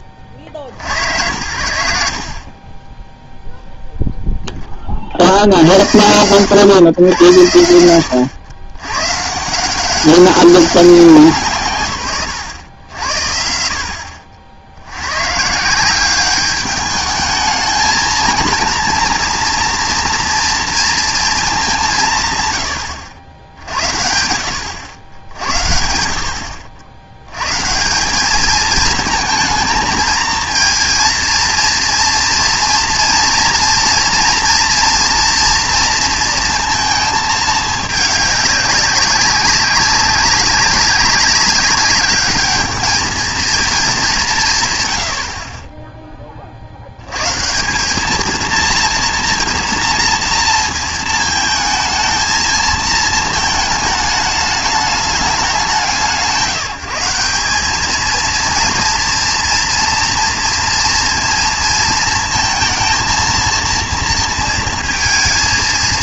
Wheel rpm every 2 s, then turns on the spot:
50, 40, 10, 110, 90, 190, 100, 70, 210, 230, 230, 110, 90, 80, 220, 230, 230, 230, 230, 200, 200, 210, 140, 60, 230, 230, 220, 210, 180, 230, 230, 230, 230.
none